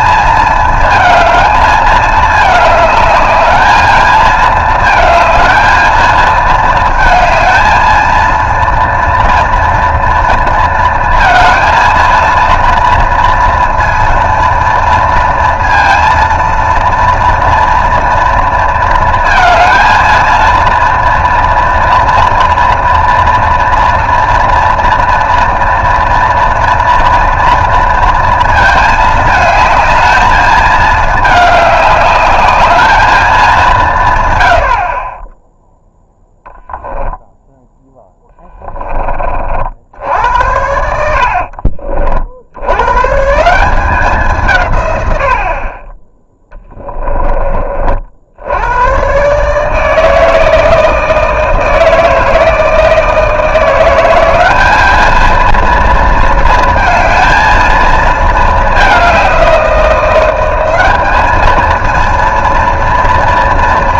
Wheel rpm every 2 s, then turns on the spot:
220, 210, 230, 220, 230, 230, 230, 230, 230, 220, 230, 230, 230, 240, 220, 220, 220, 60, 0, 20, 80, 110, 120, 10, 100, 160, 160, 210, 230, 210, 200, 230.
40-42 46-48